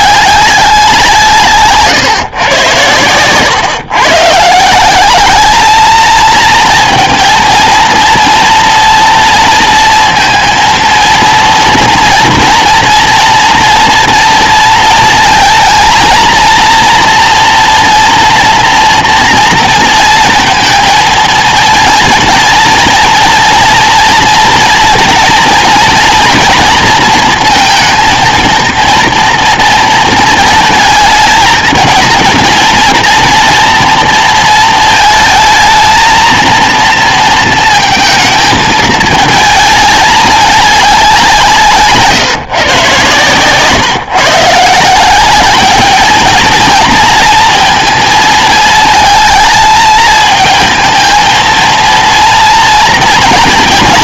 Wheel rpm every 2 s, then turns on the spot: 200, 110, 160, 230, 240, 230, 230, 230, 230, 240, 230, 230, 240, 230, 230, 220, 230, 220, 230, 220, 200, 140, 160, 230, 220, 220, 240.
none